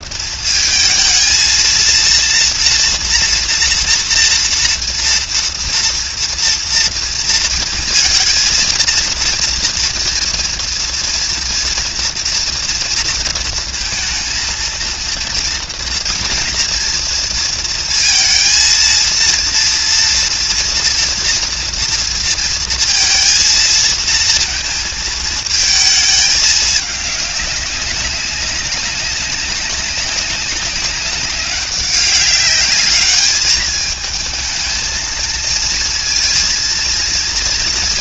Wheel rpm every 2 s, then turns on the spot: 220, 230, 230, 230, 230, 230, 230, 230, 230, 230, 230, 230, 220, 210, 200, 190, 200, 220, 230.
none